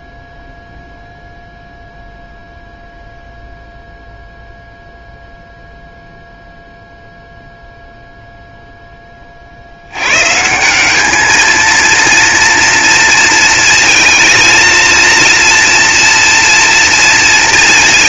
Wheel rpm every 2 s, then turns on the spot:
0, 0, 0, 0, 0, 180, 230, 230, 240.
none